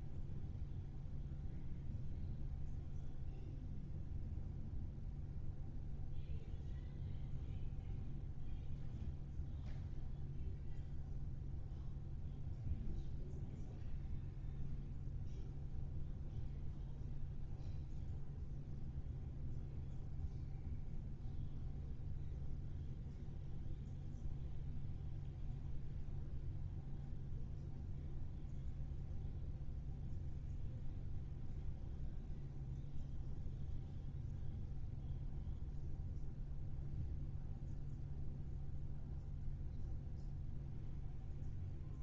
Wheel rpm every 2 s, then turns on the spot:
0, 0, 0, 0, 0, 0, 0, 0, 0, 0, 0, 0, 0, 0, 0, 0, 0, 0, 0, 0, 0.
none